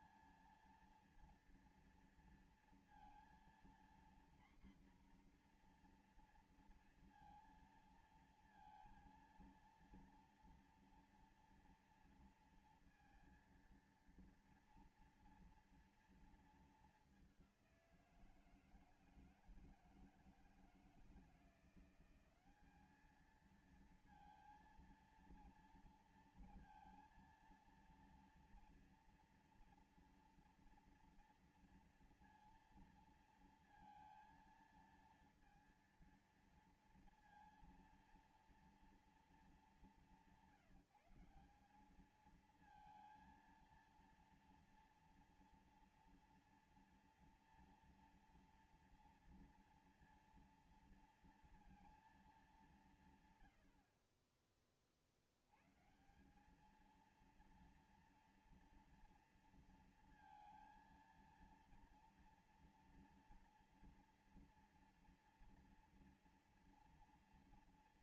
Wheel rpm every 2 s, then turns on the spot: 230, 230, 240, 230, 230, 230, 230, 230, 230, 170, 160, 190, 230, 230, 230, 230, 230, 230, 230, 230, 190, 220, 230, 230, 230, 230, 200, 30, 190, 240, 230, 230, 230, 230.
none